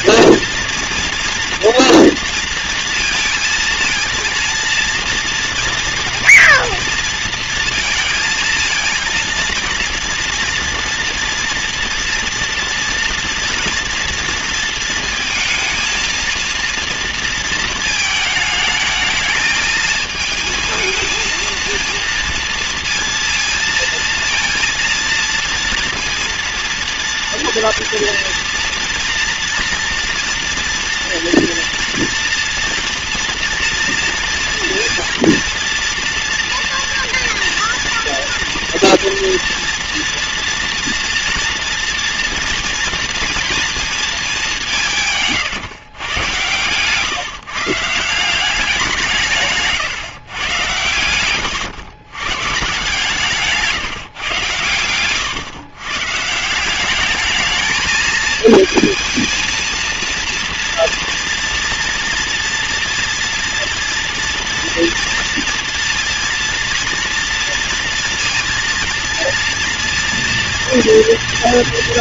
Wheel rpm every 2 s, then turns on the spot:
230, 230, 230, 230, 230, 240, 230, 220, 230, 220, 220, 230, 230, 230, 240, 230, 240, 230, 230, 230, 240, 230, 140, 140, 160, 110, 160, 110, 210, 230, 240, 240, 230, 230, 230, 230.
44-46